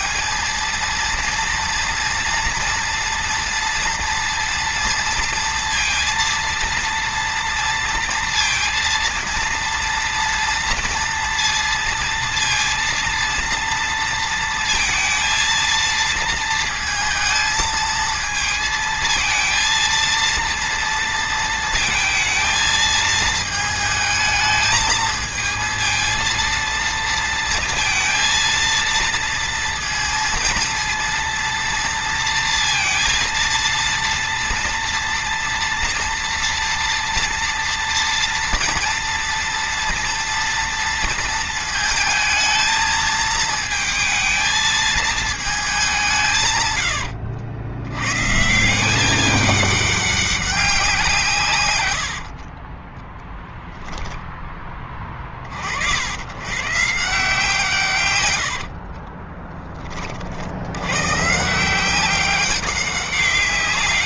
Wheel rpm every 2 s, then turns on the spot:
230, 230, 230, 230, 230, 230, 230, 220, 230, 230, 230, 220, 220, 230, 230, 230, 230, 230, 230, 240, 230, 220, 220, 110, 190, 180, 30, 20, 140, 40, 100, 180.
52-54 58-60